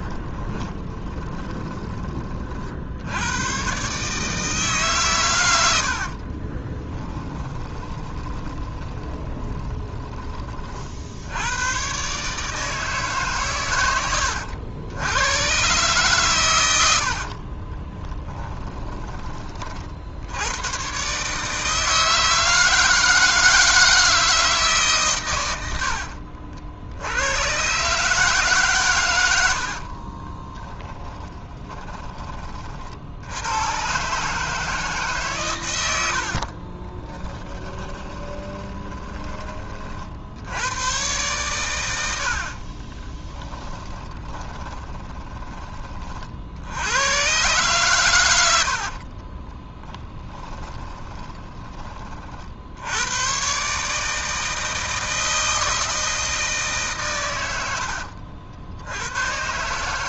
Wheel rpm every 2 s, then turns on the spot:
20, 50, 150, 30, 20, 40, 150, 90, 110, 20, 110, 160, 150, 60, 140, 10, 50, 150, 40, 20, 90, 40, 30, 80, 80, 20, 60, 160, 150, 70.
0-2 6-10 18-20 30-32 36-40 42-46 50-52